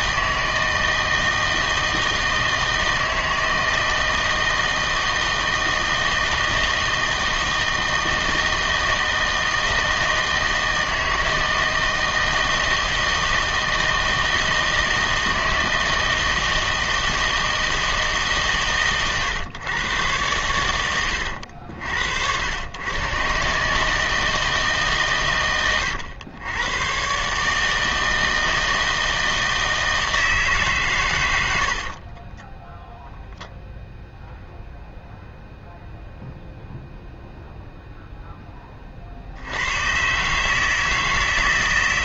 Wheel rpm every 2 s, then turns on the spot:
160, 160, 160, 160, 160, 160, 160, 160, 160, 130, 100, 100, 150, 100, 160, 150, 10, 0, 0, 20, 150.
32-34